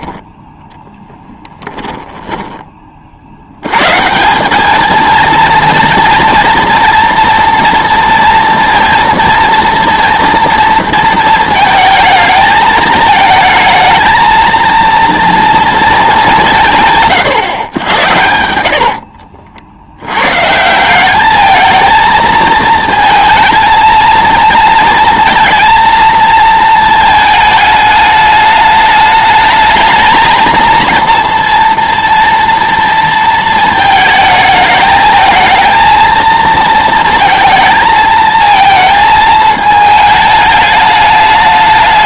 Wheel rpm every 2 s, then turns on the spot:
0, 20, 210, 230, 230, 230, 220, 230, 160, 70, 170, 220, 230, 220, 210, 230, 230, 220, 220, 220, 210.
18-20